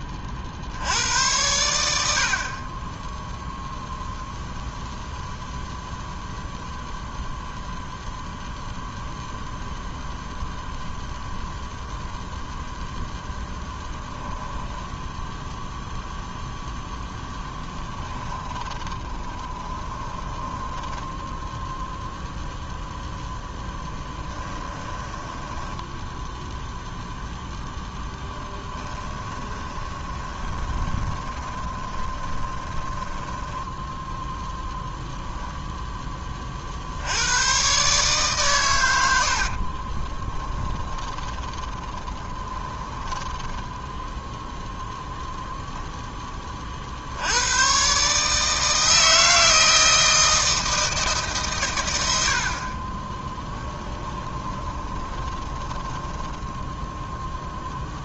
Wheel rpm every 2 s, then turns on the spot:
40, 30, 0, 0, 0, 0, 0, 10, 0, 20, 10, 0, 10, 0, 10, 20, 20, 0, 50, 120, 20, 20, 0, 30, 160, 160, 50, 20, 20.
14-16 18-22 24-26 28-34 40-44 54-58